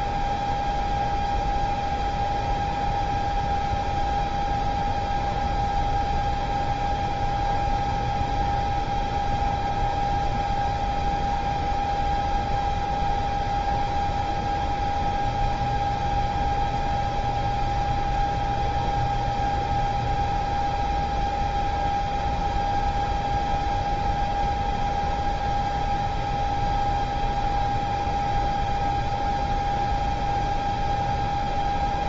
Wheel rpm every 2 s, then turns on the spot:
0, 0, 0, 0, 0, 0, 0, 0, 0, 0, 0, 0, 0, 0, 0, 0.
none